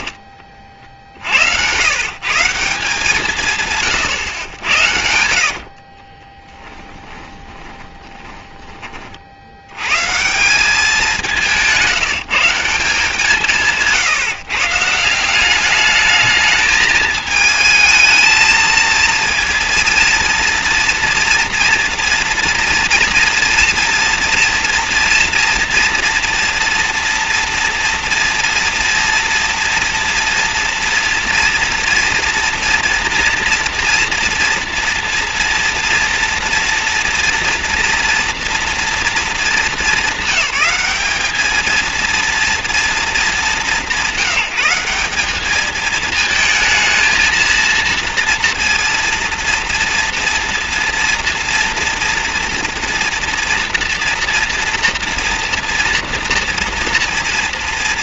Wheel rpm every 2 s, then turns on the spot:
60, 160, 80, 10, 20, 190, 180, 150, 210, 220, 230, 230, 230, 230, 230, 230, 230, 230, 230, 240, 210, 230, 190, 220, 230, 230, 240, 230, 230.
4-8